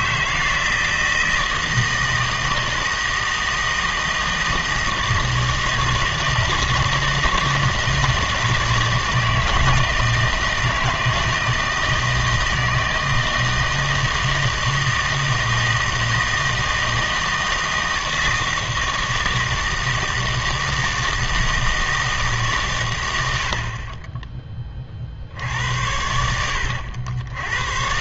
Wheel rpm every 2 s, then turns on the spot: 160, 160, 160, 160, 160, 160, 160, 160, 160, 160, 160, 120, 20, 80.
none